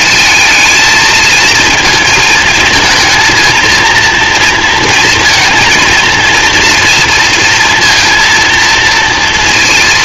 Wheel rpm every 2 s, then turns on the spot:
220, 220, 230, 230, 230.
none